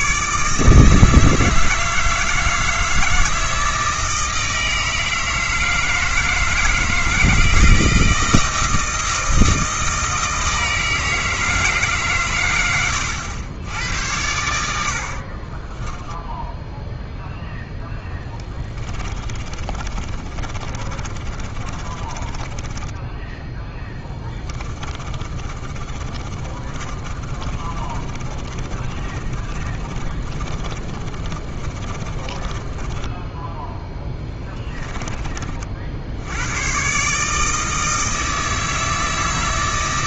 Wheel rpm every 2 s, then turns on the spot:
150, 160, 160, 160, 160, 160, 110, 80, 0, 30, 30, 20, 20, 30, 30, 30, 20, 20, 110, 160.
18-36